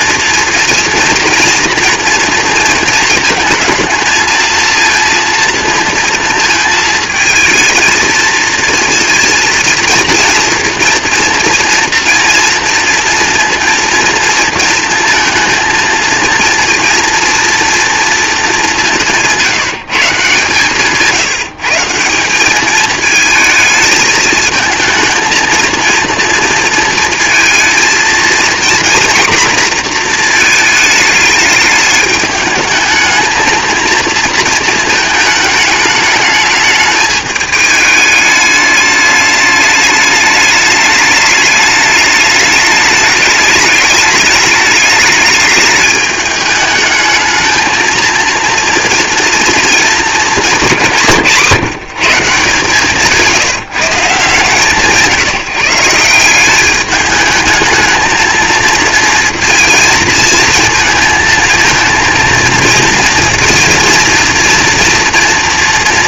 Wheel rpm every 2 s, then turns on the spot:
230, 230, 230, 220, 230, 230, 230, 230, 230, 200, 160, 200, 220, 230, 240, 230, 210, 230, 210, 210, 210, 210, 210, 210, 230, 190, 160, 160, 190, 220, 220, 230, 230.
none